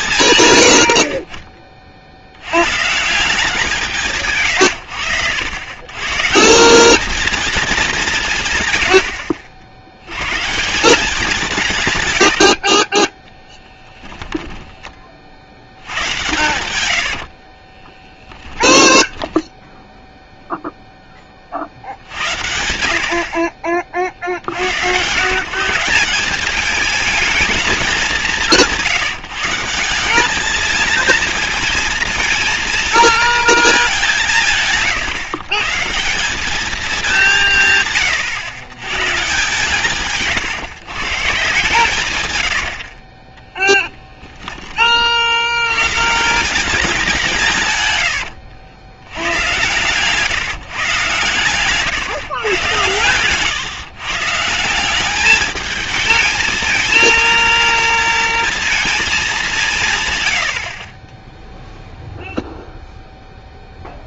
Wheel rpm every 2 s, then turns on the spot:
80, 140, 100, 190, 100, 170, 50, 20, 110, 10, 0, 60, 100, 210, 180, 220, 230, 140, 210, 130, 130, 60, 30, 200, 100, 140, 120, 180, 220, 230, 40, 0.
0-2 12-14 16-20 42-44